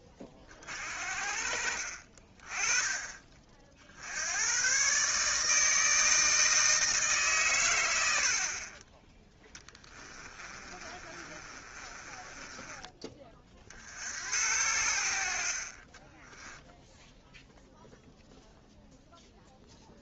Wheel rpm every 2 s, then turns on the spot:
40, 20, 110, 160, 40, 30, 20, 80, 10, 0.
10-14